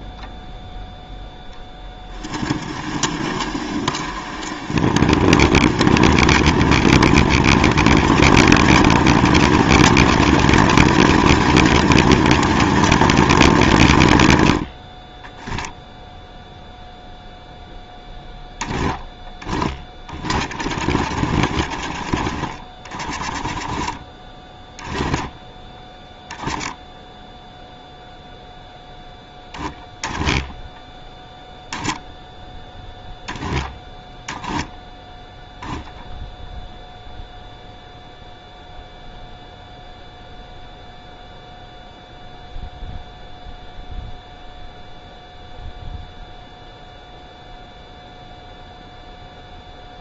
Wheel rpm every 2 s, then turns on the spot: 0, 30, 30, 40, 50, 50, 50, 10, 0, 10, 30, 30, 10, 10, 10, 10, 0, 10, 0, 0, 0, 0, 0, 0, 0.
18-24 34-36